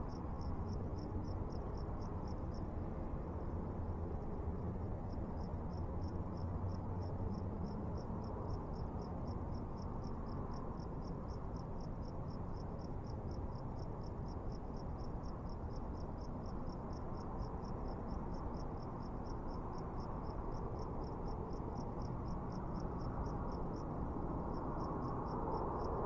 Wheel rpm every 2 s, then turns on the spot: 0, 0, 0, 0, 0, 0, 0, 0, 0, 0, 0, 0, 0.
none